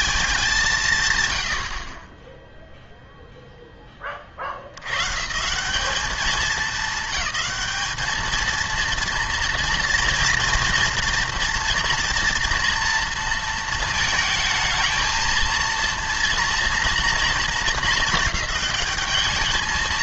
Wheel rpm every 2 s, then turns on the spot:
170, 0, 90, 200, 230, 230, 230, 220, 230, 210.
none